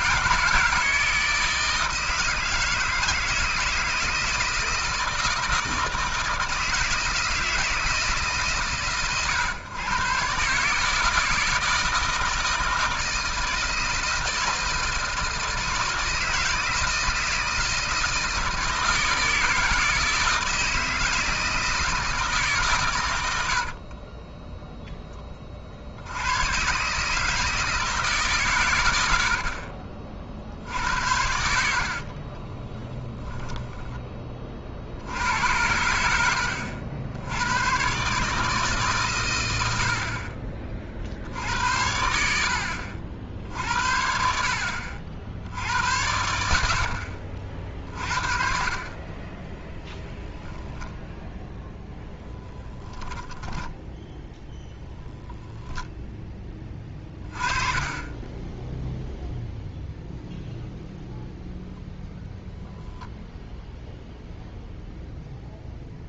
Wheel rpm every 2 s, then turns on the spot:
160, 160, 160, 160, 140, 140, 160, 170, 160, 160, 160, 150, 10, 120, 130, 60, 20, 40, 80, 150, 40, 70, 60, 80, 50, 0, 10, 0, 10, 10, 0, 0, 0.
24-26 32-34 52-54